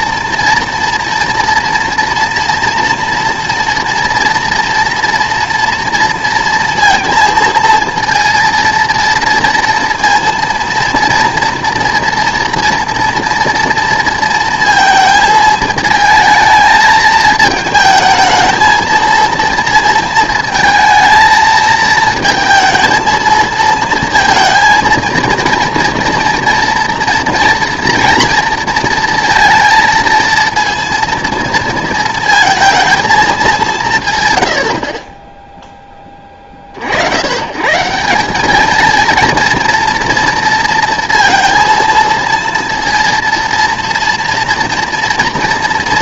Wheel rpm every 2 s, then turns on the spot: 230, 240, 230, 230, 230, 230, 230, 220, 220, 220, 220, 230, 230, 230, 230, 230, 230, 80, 40, 210, 230, 230, 230.
none